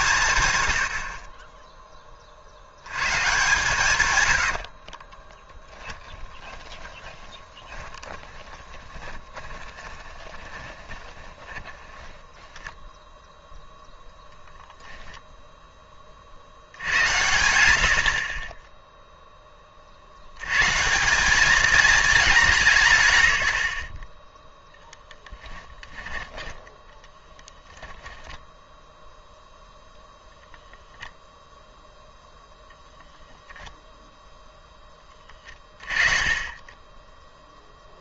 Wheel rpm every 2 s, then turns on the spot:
90, 80, 60, 20, 20, 20, 10, 0, 60, 10, 130, 110, 0, 10, 0, 0, 0, 10, 20.
4-12 26-28